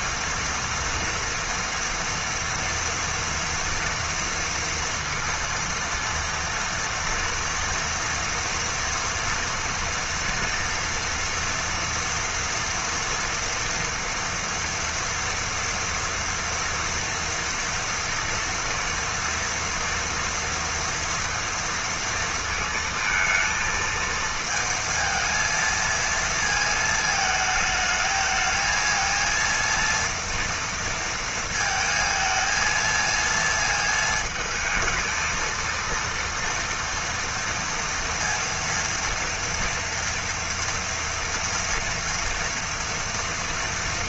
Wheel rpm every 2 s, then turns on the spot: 230, 230, 230, 230, 230, 240, 230, 230, 230, 230, 240, 230, 230, 220, 220, 230, 230, 220, 230, 230, 230, 230.
none